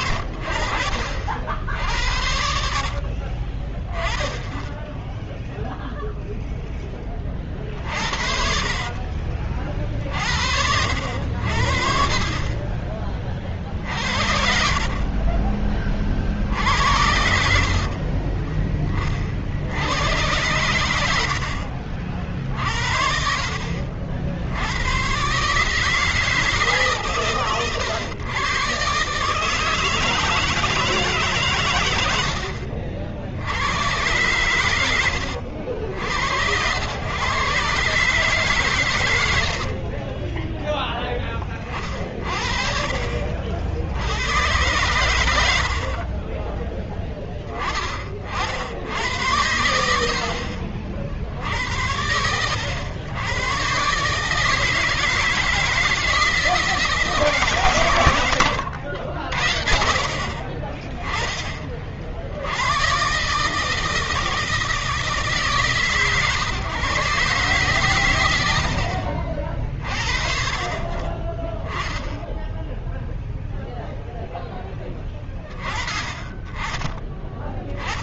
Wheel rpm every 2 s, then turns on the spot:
50, 60, 10, 0, 50, 60, 30, 50, 70, 20, 100, 60, 90, 150, 130, 160, 70, 110, 90, 120, 10, 40, 100, 20, 60, 50, 100, 160, 160, 110, 30, 90, 160, 130, 90, 40, 0, 0, 20.
2-4 8-10 14-18